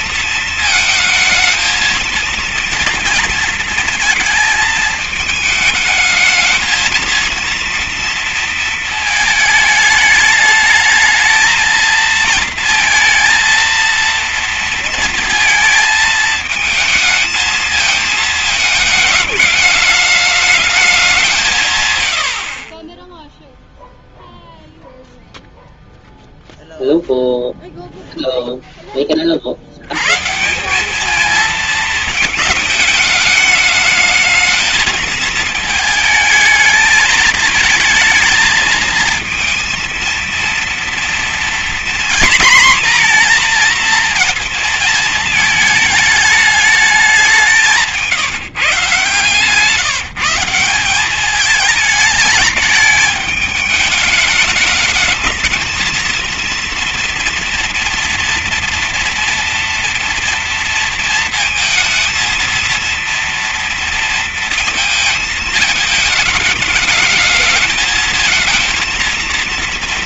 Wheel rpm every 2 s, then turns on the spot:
220, 230, 220, 220, 220, 220, 230, 230, 220, 210, 190, 10, 0, 0, 50, 220, 220, 220, 220, 230, 230, 240, 220, 190, 140, 190, 210, 220, 230, 240, 230, 230, 220, 220, 230.
none